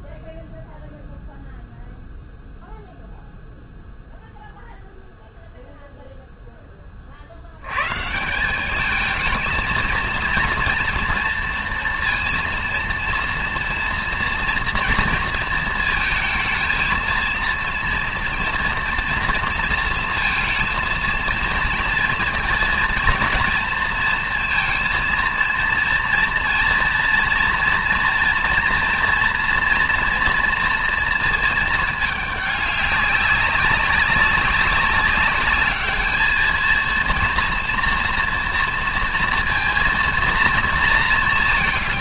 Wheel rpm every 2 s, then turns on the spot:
0, 0, 0, 20, 210, 230, 230, 230, 220, 230, 230, 230, 230, 230, 230, 230, 200, 190, 220, 230, 230.
none